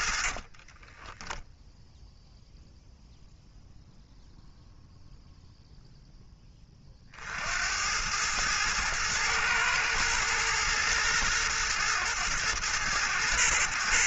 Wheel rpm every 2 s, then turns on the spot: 30, 0, 0, 20, 110, 110, 110.
0-2